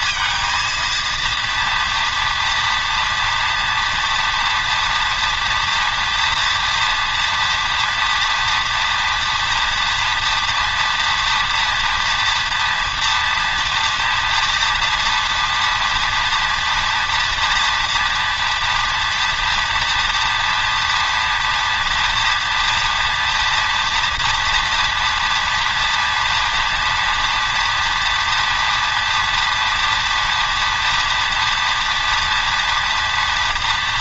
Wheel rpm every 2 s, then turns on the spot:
230, 230, 230, 230, 230, 240, 230, 230, 230, 230, 230, 240, 230, 230, 230, 230, 230.
none